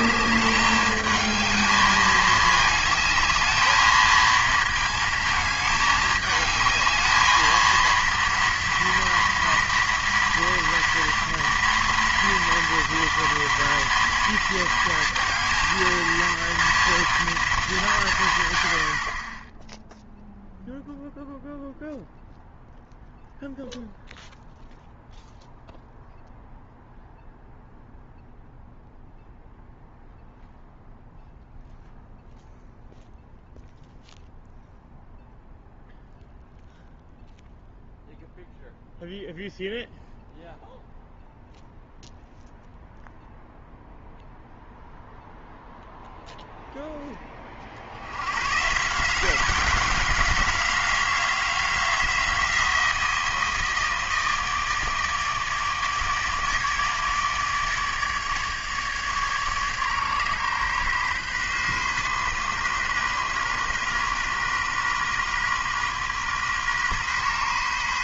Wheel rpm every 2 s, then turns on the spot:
210, 220, 220, 210, 230, 230, 230, 230, 230, 110, 0, 0, 0, 0, 0, 0, 0, 0, 0, 0, 0, 0, 0, 0, 140, 190, 170, 160, 150, 150, 140, 130, 130, 130.
none